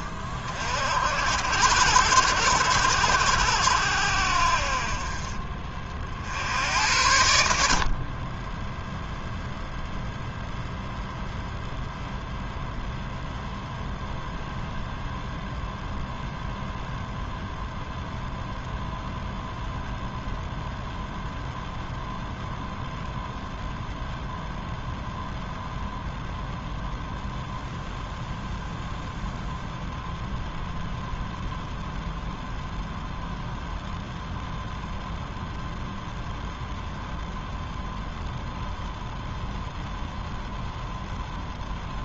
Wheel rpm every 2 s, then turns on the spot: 40, 70, 50, 80, 0, 0, 0, 0, 0, 0, 0, 0, 0, 0, 0, 0, 0, 0, 0, 0, 0.
none